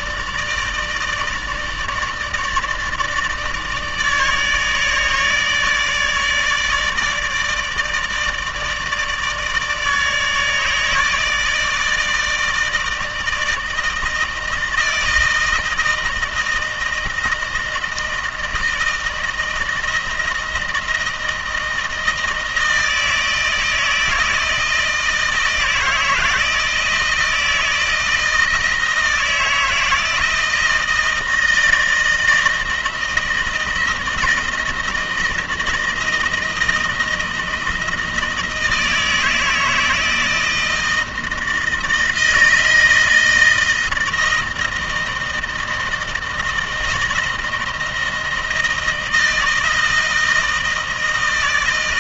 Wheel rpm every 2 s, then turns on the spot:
160, 150, 150, 150, 150, 160, 160, 160, 160, 160, 160, 160, 160, 160, 160, 160, 160, 170, 160, 160, 160, 160, 160, 160, 160, 160.
none